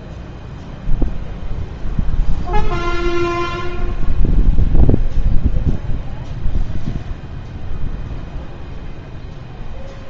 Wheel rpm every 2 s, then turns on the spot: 0, 0, 0, 0, 0.
none